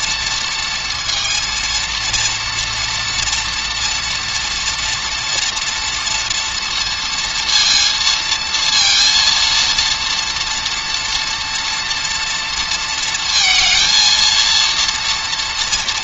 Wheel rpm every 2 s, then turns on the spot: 230, 230, 240, 230, 230, 230, 230, 230.
none